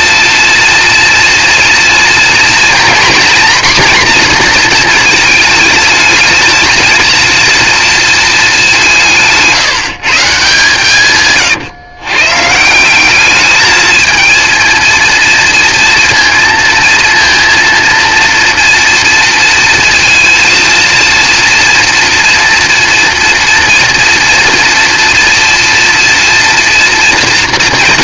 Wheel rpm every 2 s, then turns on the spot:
230, 240, 230, 230, 180, 140, 180, 230, 230, 240, 230, 230, 230, 230.
none